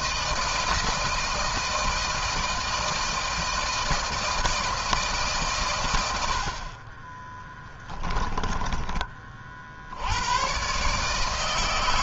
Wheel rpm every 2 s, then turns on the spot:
160, 160, 160, 60, 20, 100.
8-10